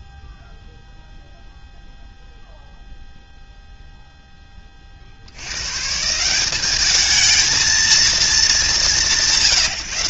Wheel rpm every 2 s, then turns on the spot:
0, 0, 0, 160, 220.
none